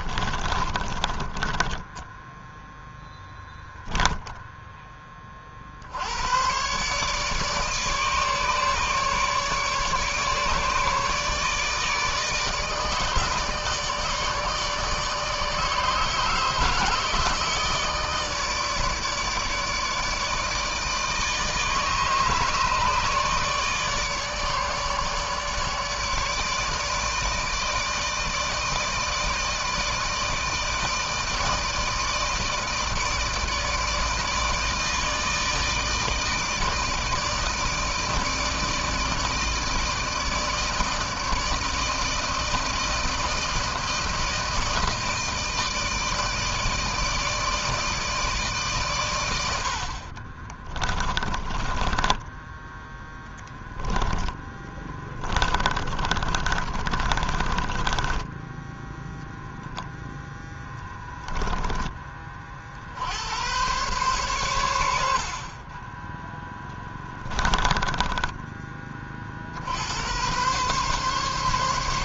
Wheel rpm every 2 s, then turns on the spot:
20, 0, 10, 110, 150, 150, 150, 160, 150, 150, 150, 150, 150, 150, 160, 160, 160, 160, 160, 160, 160, 160, 160, 160, 150, 30, 10, 10, 30, 10, 10, 40, 110, 10, 20, 120.
0-2 50-52 54-60 66-68